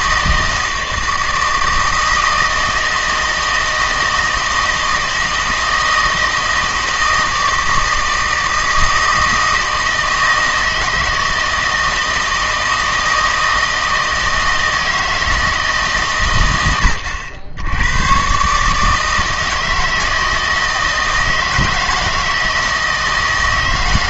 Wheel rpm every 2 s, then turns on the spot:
160, 160, 160, 160, 160, 160, 160, 160, 100, 150, 160, 160.
none